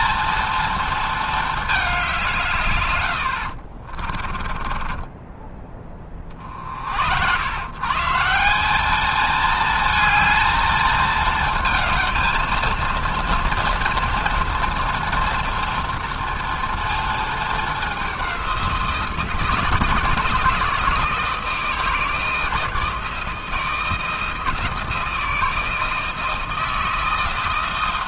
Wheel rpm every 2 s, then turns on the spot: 220, 70, 20, 100, 220, 220, 230, 230, 220, 170, 160, 160, 160, 170.
2-6